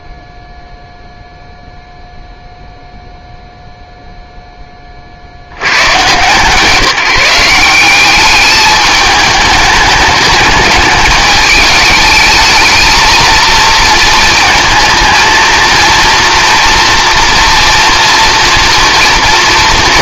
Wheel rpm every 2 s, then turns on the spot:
0, 0, 10, 170, 210, 210, 220, 220, 230, 230.
none